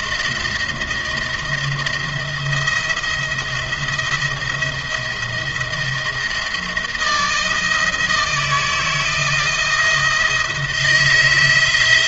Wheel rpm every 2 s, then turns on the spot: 160, 170, 170, 160, 160, 170.
none